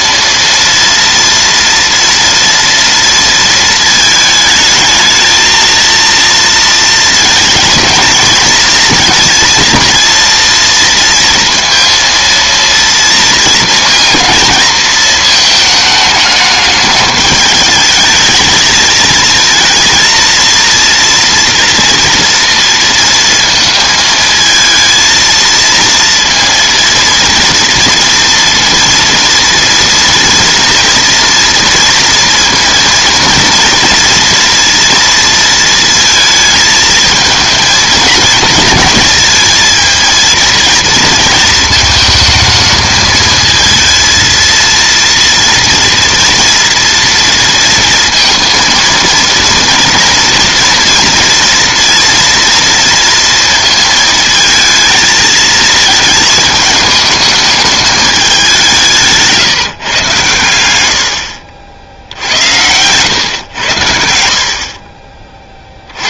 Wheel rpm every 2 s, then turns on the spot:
230, 230, 220, 220, 230, 230, 230, 220, 210, 220, 230, 230, 230, 230, 230, 230, 230, 230, 220, 230, 230, 220, 230, 230, 230, 240, 230, 220, 210, 160, 70, 110, 30.
58-62